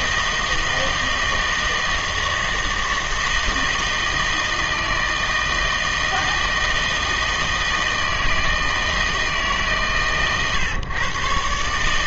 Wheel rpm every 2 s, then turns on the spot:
160, 160, 160, 160, 160, 120.
none